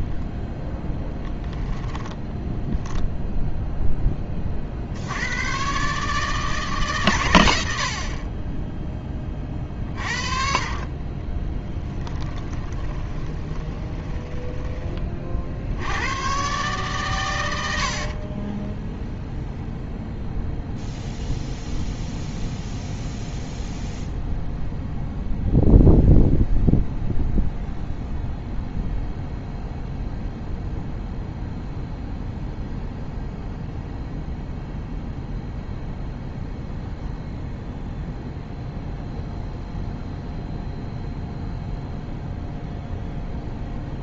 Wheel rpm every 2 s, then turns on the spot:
10, 10, 30, 150, 20, 40, 20, 20, 130, 20, 0, 0, 0, 0, 0, 0, 0, 0, 0, 0, 0, 0.
12-16 18-20